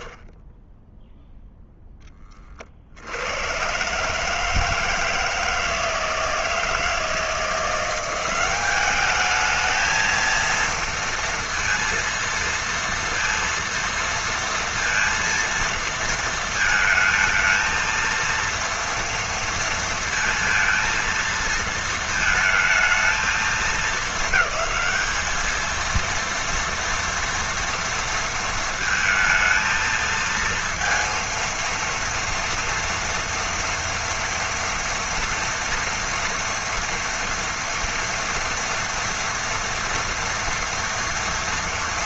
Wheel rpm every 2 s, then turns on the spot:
40, 30, 160, 160, 190, 230, 230, 230, 230, 230, 230, 220, 200, 230, 230, 230, 240, 230, 230, 230, 230.
none